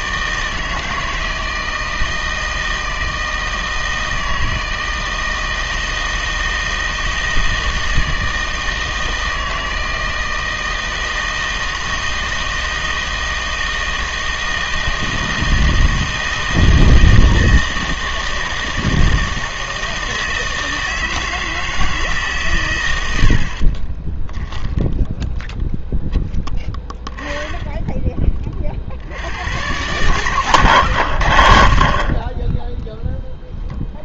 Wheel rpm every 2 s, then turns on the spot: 160, 160, 160, 160, 160, 160, 160, 160, 160, 160, 160, 120, 0, 10, 40, 100, 0.
none